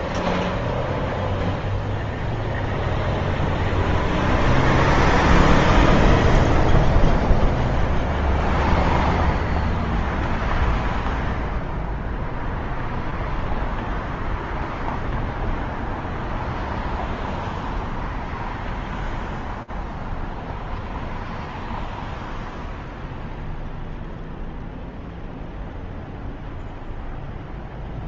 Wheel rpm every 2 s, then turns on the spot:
0, 0, 0, 0, 0, 0, 0, 0, 0, 0, 0, 0, 0, 0.
none